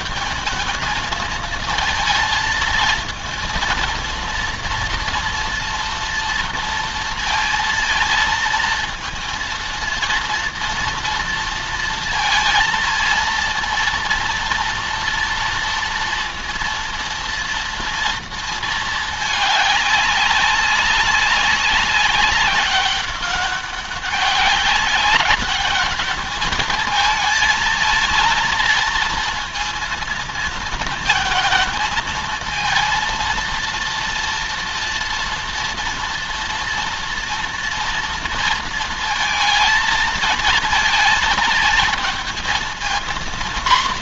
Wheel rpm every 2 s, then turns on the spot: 220, 230, 240, 230, 230, 230, 230, 240, 230, 220, 190, 200, 190, 220, 230, 220, 230, 230, 230, 230, 230, 230.
none